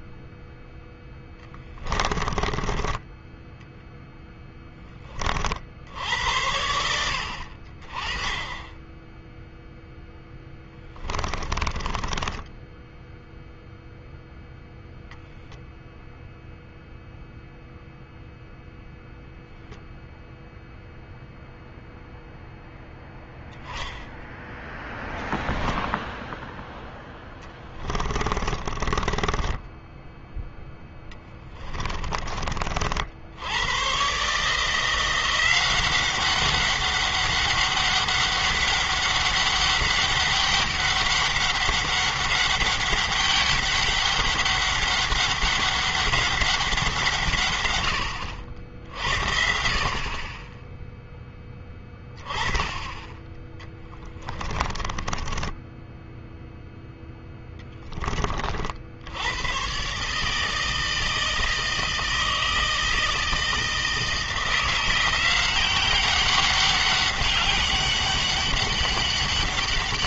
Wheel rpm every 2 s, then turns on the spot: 10, 10, 20, 80, 10, 20, 0, 0, 0, 0, 0, 0, 10, 10, 20, 10, 60, 170, 200, 200, 200, 200, 200, 160, 60, 10, 20, 20, 0, 80, 160, 160, 180, 200, 200.
0-2 10-12 28-32 54-56